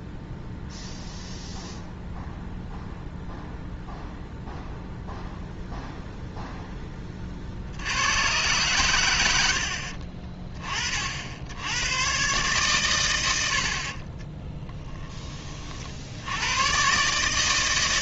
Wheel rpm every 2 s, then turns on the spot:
0, 0, 0, 10, 110, 30, 120, 10, 120.
none